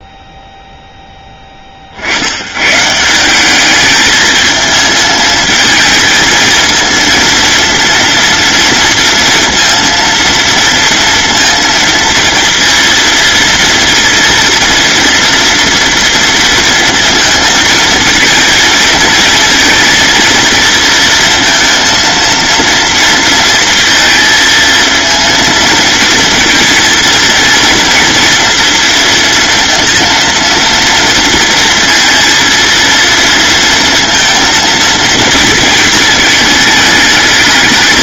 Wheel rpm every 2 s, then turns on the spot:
0, 140, 220, 220, 230, 230, 230, 230, 230, 220, 230, 230, 230, 230, 230, 230, 230, 230, 210.
none